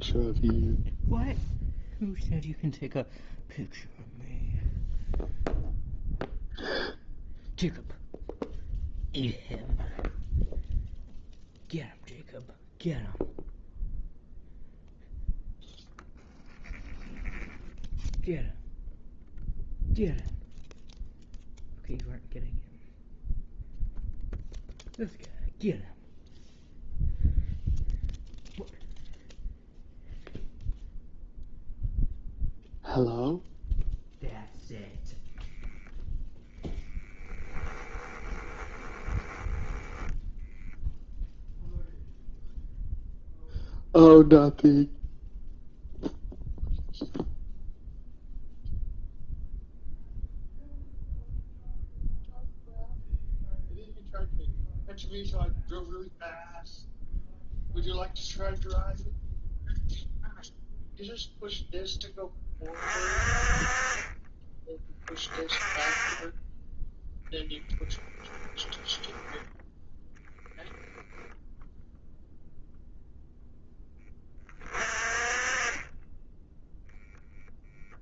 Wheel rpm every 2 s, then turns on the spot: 0, 0, 0, 0, 0, 0, 0, 0, 0, 0, 0, 0, 0, 0, 0, 0, 0, 0, 0, 10, 0, 0, 0, 0, 0, 0, 0, 0, 0, 0, 0, 30, 30, 10, 10, 0, 0, 30, 0.
38-40